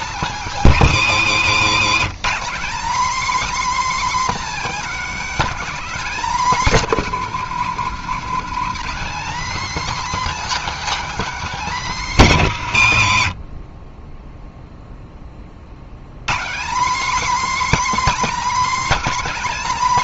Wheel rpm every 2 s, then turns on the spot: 250, 250, 290, 260, 250, 290, 180, 0, 200, 310.
none